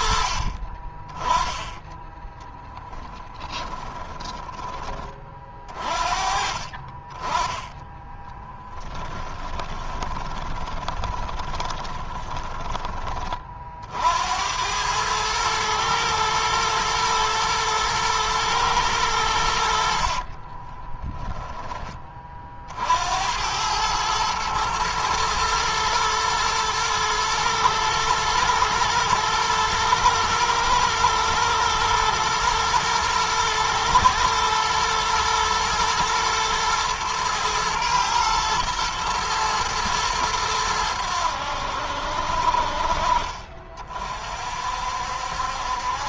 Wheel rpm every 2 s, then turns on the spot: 40, 10, 20, 40, 10, 20, 20, 80, 120, 110, 50, 40, 110, 110, 110, 110, 110, 110, 110, 120, 110, 60, 60.
2-4 8-14 20-22